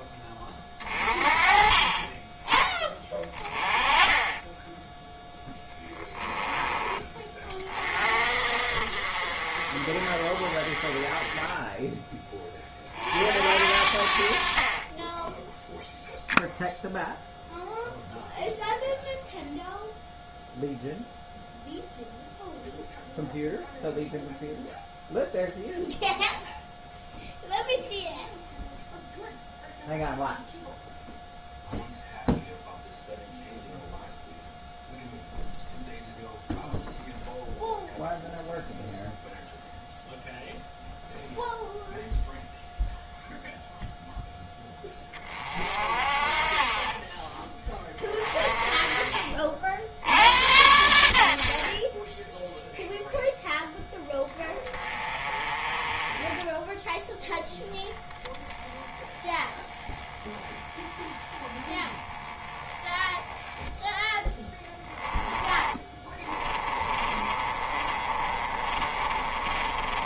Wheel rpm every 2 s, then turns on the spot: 30, 10, 10, 20, 50, 30, 40, 20, 0, 0, 0, 0, 0, 0, 0, 0, 0, 0, 0, 0, 0, 0, 20, 20, 30, 80, 0, 20, 10, 10, 10, 10, 10, 30, 30.
64-70